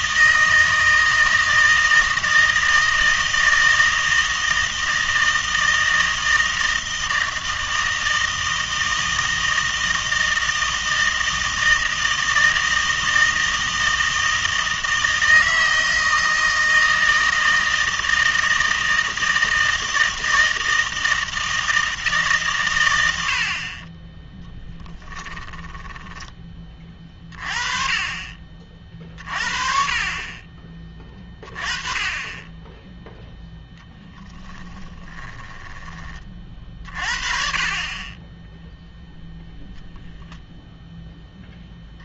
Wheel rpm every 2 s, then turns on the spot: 160, 160, 160, 160, 160, 160, 160, 160, 160, 160, 160, 130, 10, 20, 40, 20, 10, 20, 40, 0, 0.
24-26 34-36